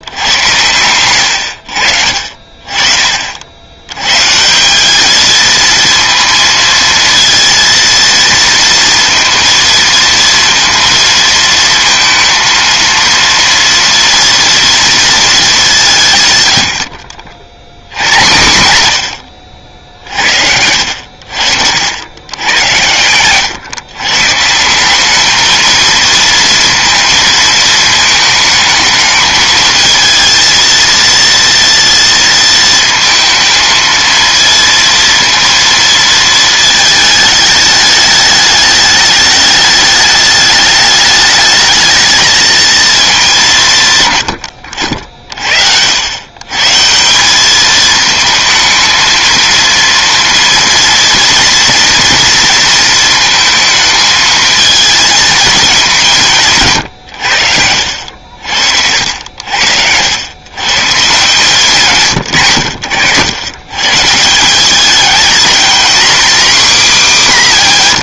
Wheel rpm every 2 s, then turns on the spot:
100, 50, 170, 230, 230, 230, 230, 230, 90, 110, 70, 110, 160, 230, 220, 230, 220, 230, 230, 210, 210, 220, 80, 140, 220, 230, 230, 220, 160, 70, 130, 100, 190, 270.
20-22